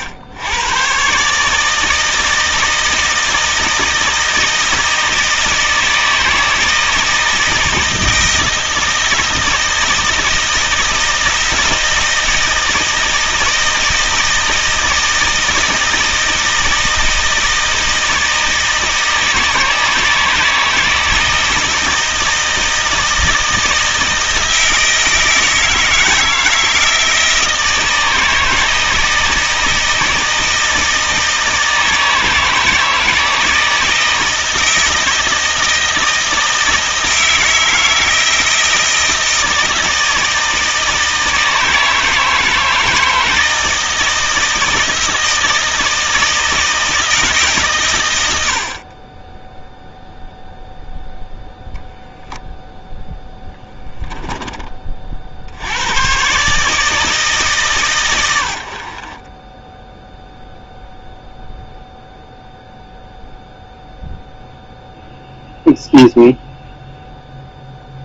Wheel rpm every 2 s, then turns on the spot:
100, 160, 160, 160, 160, 160, 160, 160, 160, 160, 160, 160, 160, 160, 160, 160, 160, 160, 160, 160, 160, 160, 160, 160, 50, 0, 0, 40, 160, 50, 0, 0, 0, 0.
none